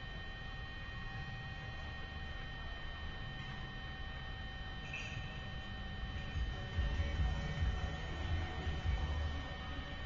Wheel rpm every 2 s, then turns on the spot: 0, 0, 0, 0, 0.
none